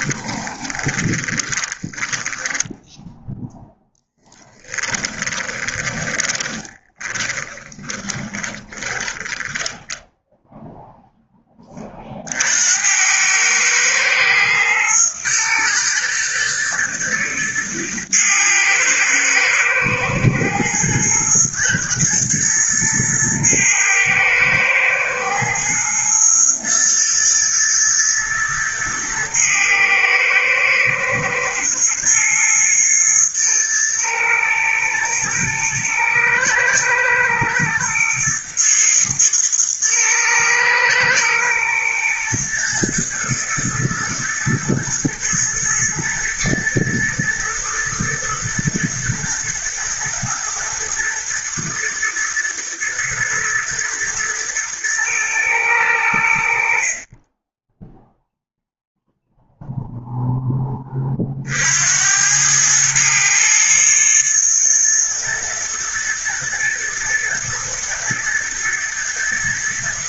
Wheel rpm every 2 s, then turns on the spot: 20, 10, 10, 10, 10, 0, 80, 110, 110, 110, 110, 110, 110, 120, 110, 110, 120, 110, 110, 110, 110, 120, 110, 120, 110, 110, 110, 120, 40, 0, 30, 110, 120, 110, 110.
0-10